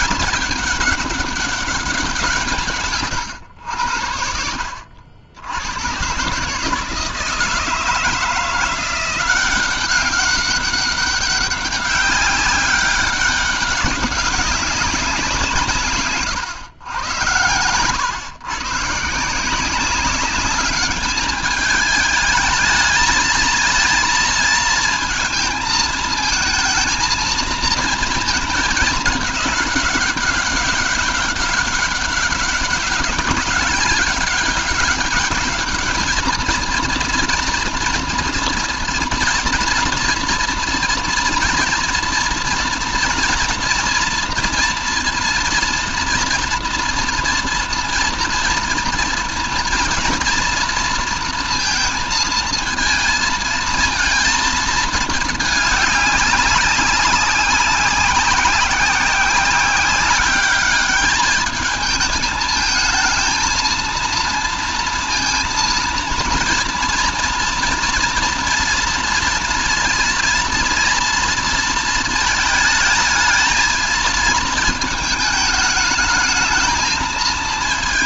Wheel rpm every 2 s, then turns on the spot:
200, 150, 70, 150, 170, 200, 200, 190, 110, 130, 200, 220, 230, 230, 220, 200, 200, 200, 220, 230, 230, 230, 240, 240, 230, 230, 230, 220, 190, 190, 210, 220, 230, 230, 230, 230, 220, 220, 220.
none